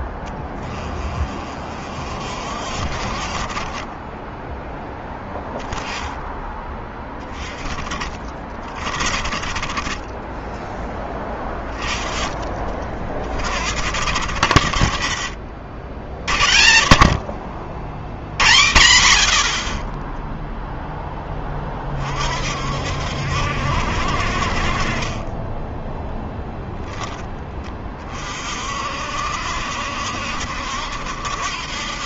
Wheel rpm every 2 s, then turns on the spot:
30, 40, 10, 20, 30, 10, 30, 60, 60, 80, 10, 70, 30, 10, 60, 70.
24-26